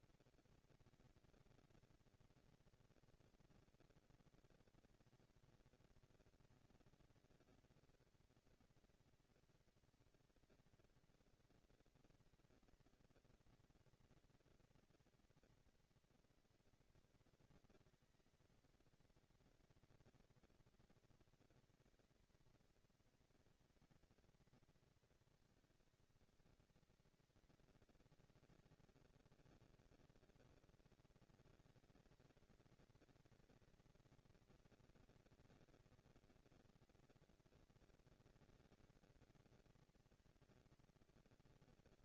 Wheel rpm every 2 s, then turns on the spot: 230, 230, 230, 230, 230, 230, 230, 230, 230, 230, 230, 230, 230, 190, 200, 220, 230, 230, 240, 230, 230.
none